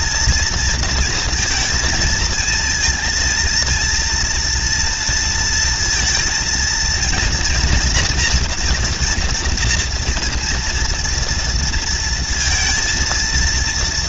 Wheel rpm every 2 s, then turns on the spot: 230, 220, 230, 230, 230, 230, 230.
none